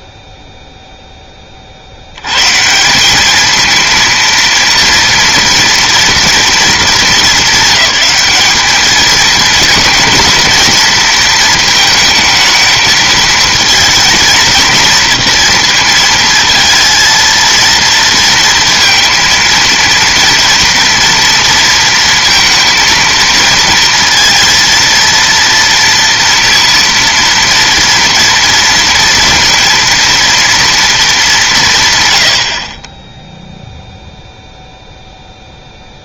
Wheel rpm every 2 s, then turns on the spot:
0, 150, 230, 220, 210, 230, 220, 230, 230, 230, 230, 230, 230, 240, 230, 230, 40, 0.
none